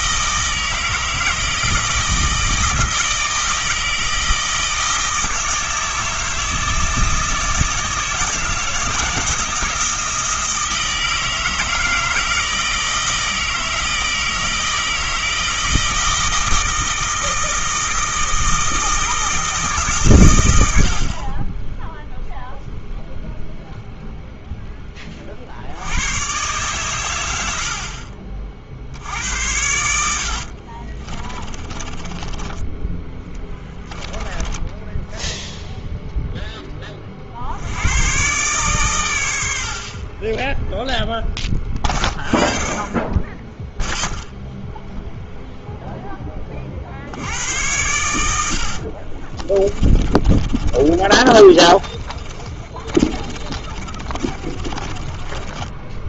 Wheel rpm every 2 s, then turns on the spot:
160, 160, 160, 160, 160, 160, 160, 160, 160, 160, 80, 0, 10, 120, 50, 50, 20, 10, 10, 130, 10, 20, 0, 40, 70, 30, 30, 30.
30-36 48-56